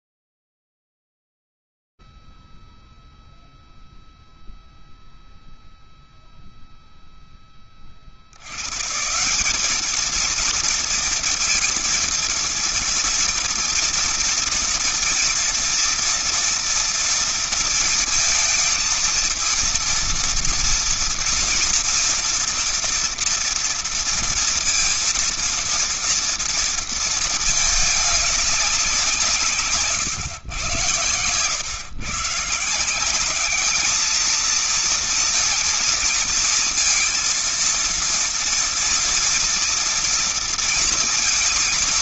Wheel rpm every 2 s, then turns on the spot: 0, 0, 0, 0, 50, 210, 230, 230, 230, 230, 230, 240, 230, 230, 210, 140, 130, 210, 230, 230, 230.
none